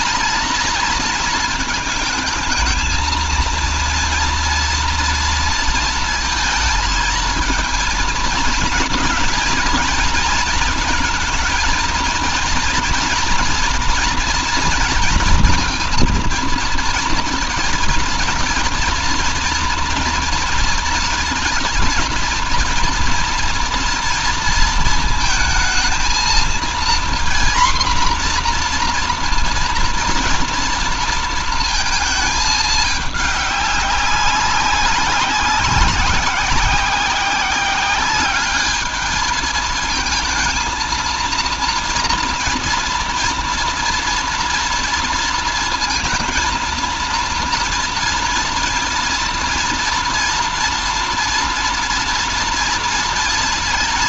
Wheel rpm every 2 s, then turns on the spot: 220, 220, 230, 230, 230, 220, 230, 240, 230, 230, 230, 230, 230, 230, 240, 230, 210, 190, 190, 210, 230, 230, 230, 230, 230, 230, 230.
none